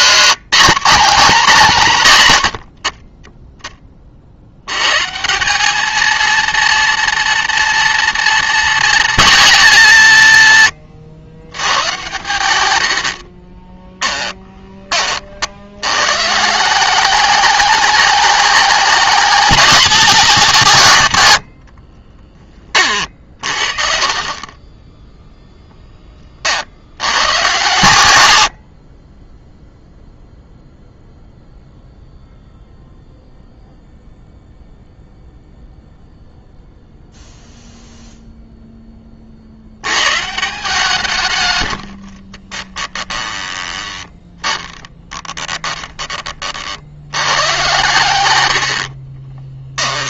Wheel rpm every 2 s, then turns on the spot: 220, 90, 90, 230, 230, 120, 90, 20, 180, 210, 160, 30, 20, 50, 70, 0, 0, 0, 0, 10, 170, 20, 10, 60, 70.
12-14 28-30 42-46 48-50